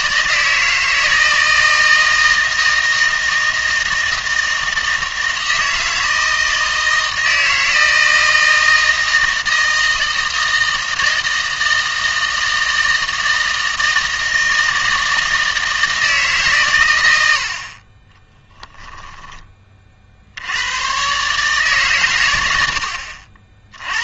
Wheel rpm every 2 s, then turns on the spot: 160, 160, 160, 160, 160, 160, 160, 160, 120, 10, 110, 80.
18-20